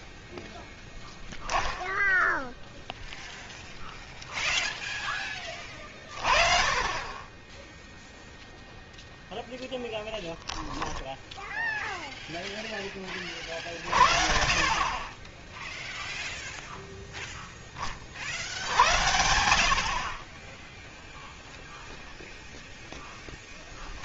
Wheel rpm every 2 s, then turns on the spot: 10, 0, 10, 20, 0, 0, 30, 20, 0, 90, 10, 0.
none